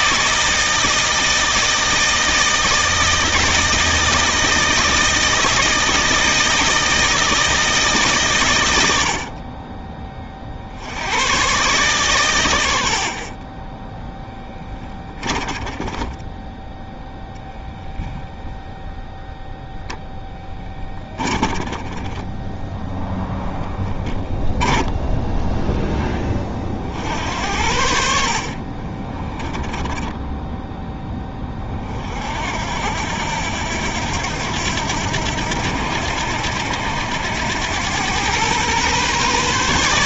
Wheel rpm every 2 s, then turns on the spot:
160, 160, 160, 160, 100, 70, 90, 20, 10, 0, 10, 0, 10, 50, 40, 10, 70, 80, 90, 130.
14-16 20-22 24-26 28-30